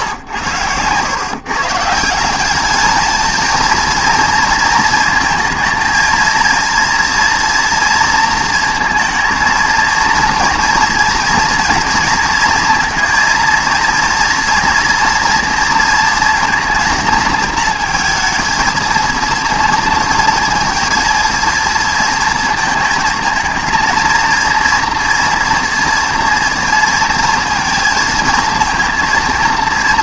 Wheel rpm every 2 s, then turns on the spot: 110, 210, 230, 230, 230, 230, 230, 230, 230, 230, 230, 220, 230, 230, 230.
none